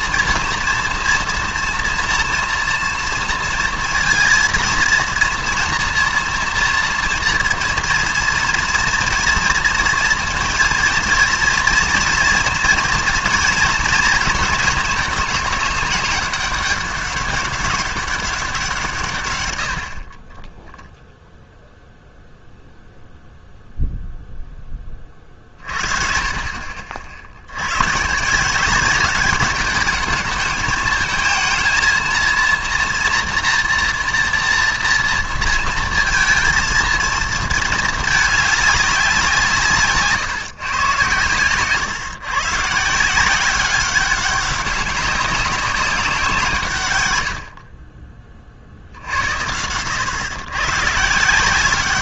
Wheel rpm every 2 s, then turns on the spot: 230, 230, 230, 230, 230, 230, 230, 210, 200, 180, 10, 0, 10, 50, 180, 220, 240, 230, 230, 200, 130, 150, 190, 150, 60, 130.
none